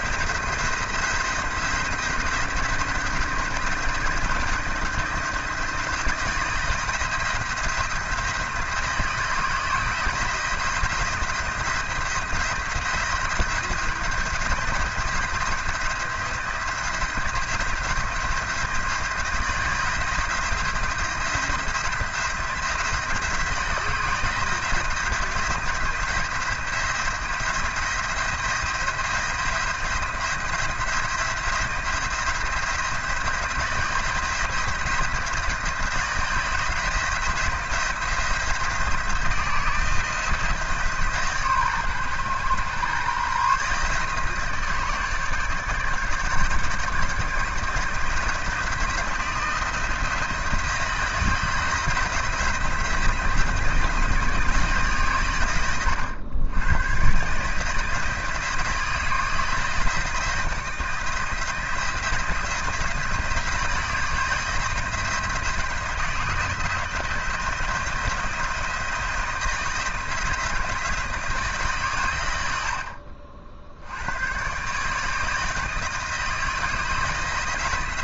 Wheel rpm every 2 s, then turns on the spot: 170, 170, 170, 170, 170, 170, 170, 170, 170, 170, 170, 170, 170, 170, 170, 170, 170, 170, 170, 170, 160, 130, 160, 160, 170, 170, 170, 150, 110, 170, 170, 170, 160, 170, 170, 160, 60, 140, 160.
72-74